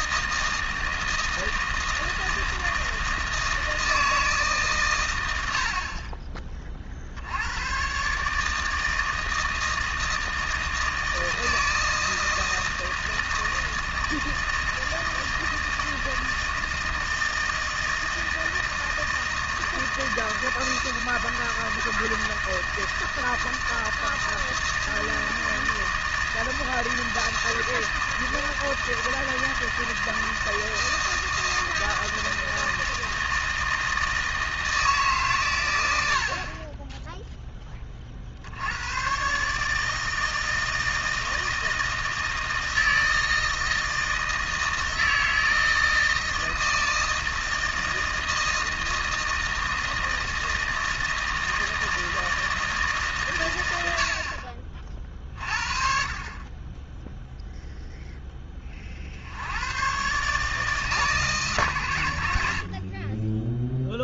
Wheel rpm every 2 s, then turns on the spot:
160, 160, 70, 110, 160, 160, 160, 160, 160, 160, 160, 160, 160, 160, 160, 160, 160, 140, 0, 110, 160, 160, 160, 160, 160, 160, 140, 30, 10, 20, 160, 50.
none